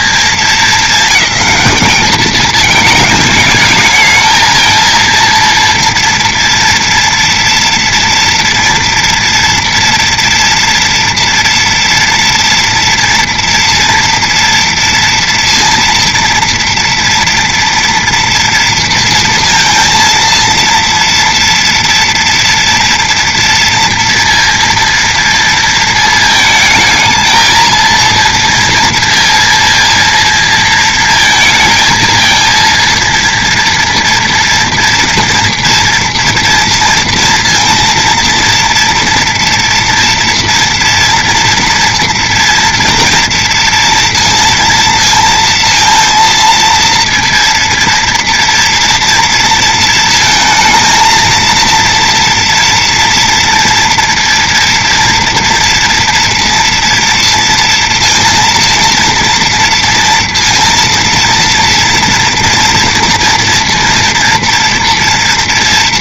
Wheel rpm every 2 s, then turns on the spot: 200, 210, 230, 230, 230, 230, 230, 230, 230, 230, 230, 230, 230, 220, 230, 230, 230, 230, 230, 230, 240, 230, 230, 230, 230, 230, 230, 230, 230, 230, 230, 240, 230.
none